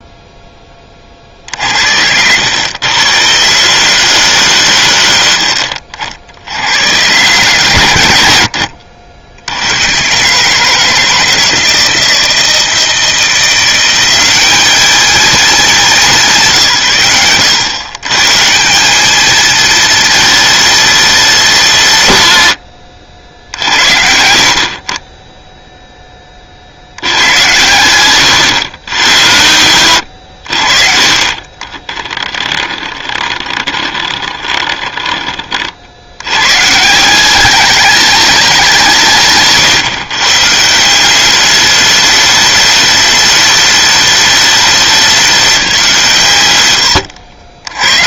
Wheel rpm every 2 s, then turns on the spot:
30, 100, 120, 70, 80, 160, 160, 200, 140, 190, 220, 130, 50, 60, 110, 50, 20, 20, 140, 180, 160, 210, 200, 110.
32-36